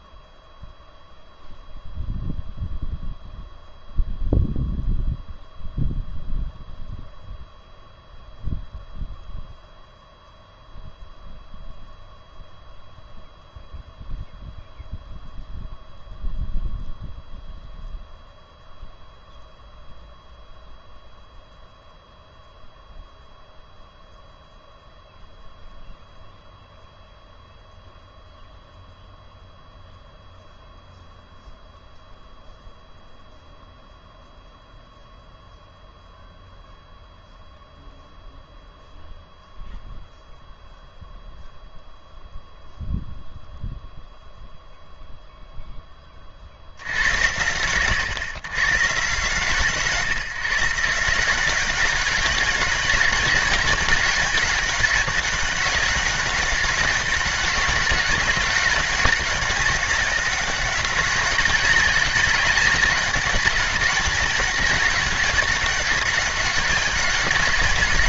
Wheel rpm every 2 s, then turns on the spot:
0, 0, 0, 0, 0, 0, 0, 0, 0, 0, 0, 0, 0, 0, 0, 0, 0, 0, 0, 0, 0, 0, 0, 60, 130, 150, 200, 200, 200, 190, 190, 200, 200, 200.
none